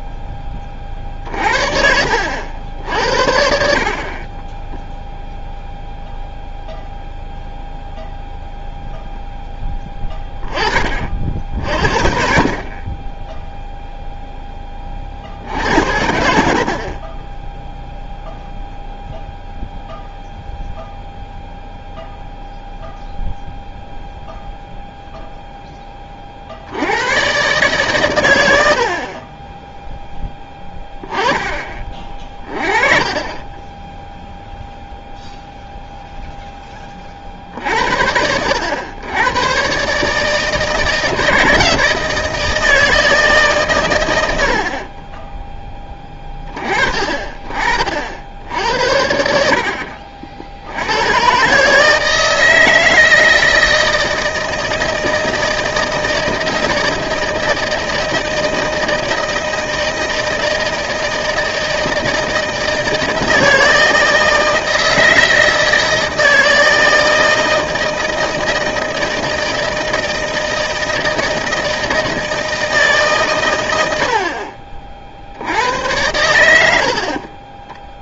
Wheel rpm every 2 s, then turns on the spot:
30, 80, 10, 0, 0, 20, 50, 10, 60, 0, 0, 0, 0, 60, 70, 10, 30, 0, 10, 90, 160, 160, 70, 20, 70, 70, 160, 160, 160, 160, 160, 160, 160, 160, 160, 160, 160, 40, 90.
4-6